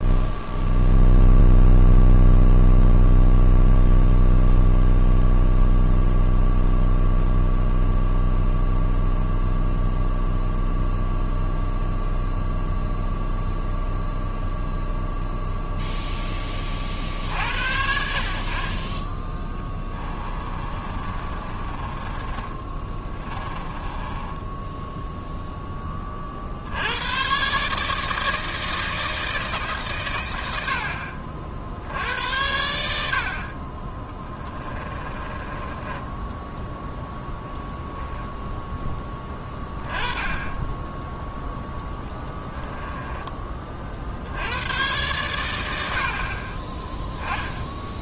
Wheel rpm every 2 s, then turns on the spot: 0, 0, 0, 0, 0, 0, 0, 0, 10, 50, 30, 30, 10, 80, 160, 70, 80, 20, 0, 10, 10, 20, 110, 30.
20-26 34-36 42-44